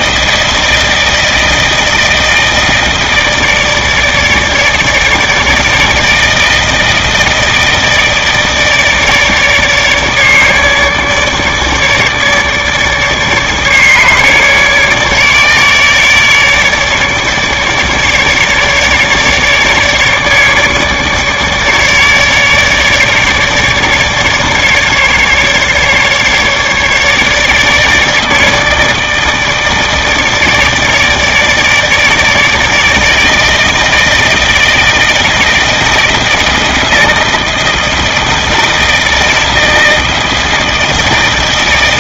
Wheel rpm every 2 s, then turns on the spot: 160, 160, 150, 160, 150, 150, 150, 150, 150, 150, 150, 150, 150, 150, 160, 160, 160, 160, 160, 160, 160.
none